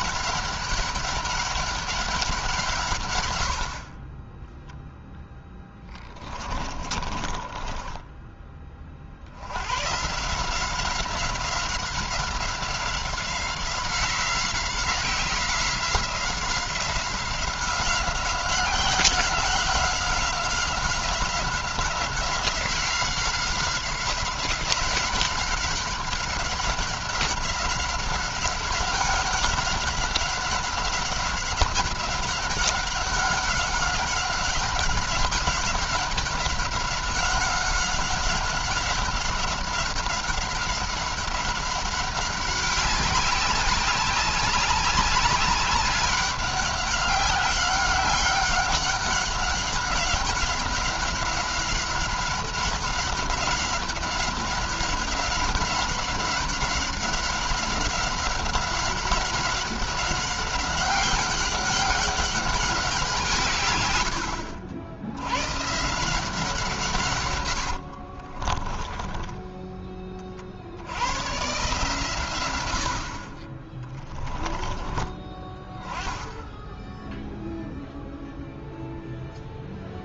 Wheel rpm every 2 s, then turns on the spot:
200, 140, 0, 30, 40, 180, 190, 180, 180, 190, 190, 180, 190, 200, 200, 190, 200, 190, 190, 190, 190, 190, 190, 190, 190, 190, 190, 190, 190, 190, 190, 180, 80, 140, 10, 100, 60, 30, 10, 0.
6-8 68-70